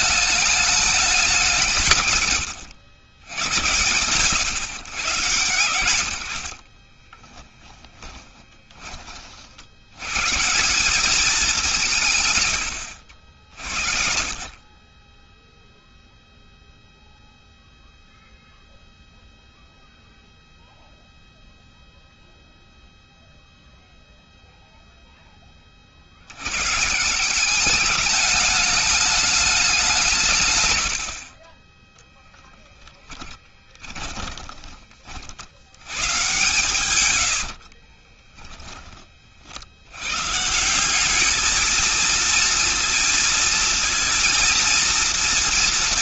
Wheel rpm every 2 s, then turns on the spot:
210, 90, 110, 30, 20, 180, 80, 20, 0, 0, 0, 0, 0, 150, 210, 90, 10, 30, 100, 30, 190, 230, 230.
6-8 32-34 36-38